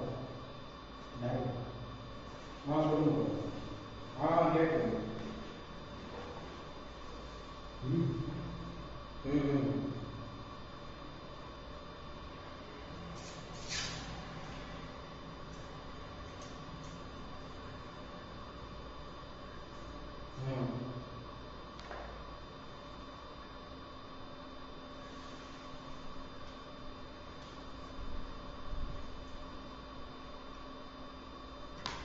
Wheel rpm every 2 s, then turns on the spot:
0, 0, 0, 0, 0, 0, 0, 0, 0, 0, 0, 0, 0, 0, 0, 0.
none